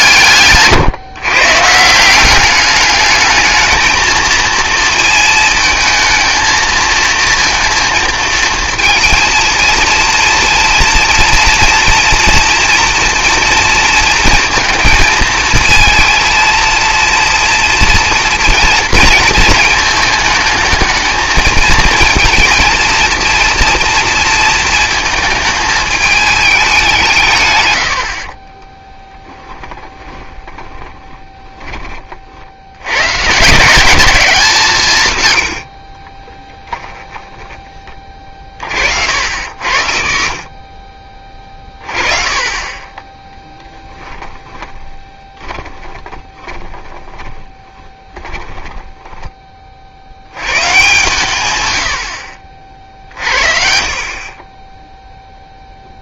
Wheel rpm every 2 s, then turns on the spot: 140, 200, 230, 220, 220, 230, 240, 230, 230, 230, 220, 230, 220, 200, 20, 20, 90, 160, 10, 40, 40, 20, 20, 20, 10, 130, 50, 10.
28-32 44-50